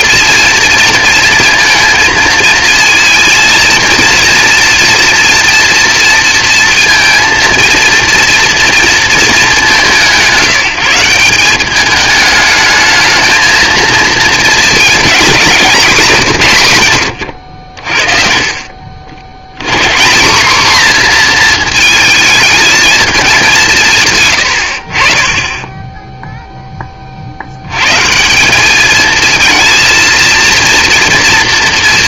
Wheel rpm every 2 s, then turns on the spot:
220, 230, 230, 230, 220, 180, 220, 230, 90, 70, 240, 210, 40, 60, 220, 230.
none